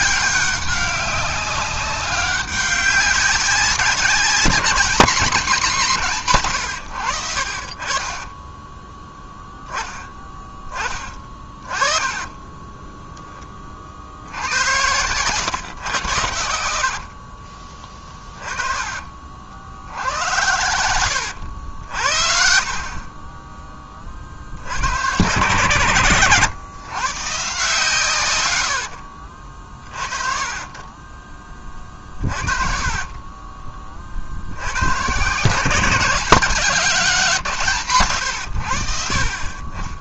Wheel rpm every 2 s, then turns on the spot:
200, 200, 190, 130, 10, 10, 30, 80, 70, 30, 100, 50, 70, 120, 100, 40, 50, 70, 190, 100.
12-14 16-24 32-34